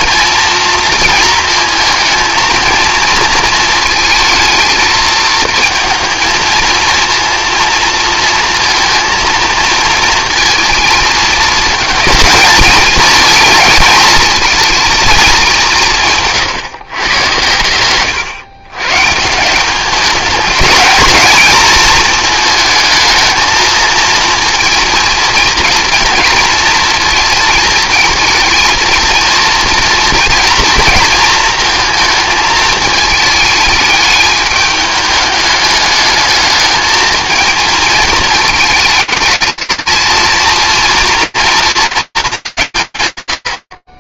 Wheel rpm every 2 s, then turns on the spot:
230, 220, 220, 220, 230, 230, 220, 230, 150, 120, 210, 230, 230, 230, 230, 230, 220, 210, 220, 220, 230, 210.
16-18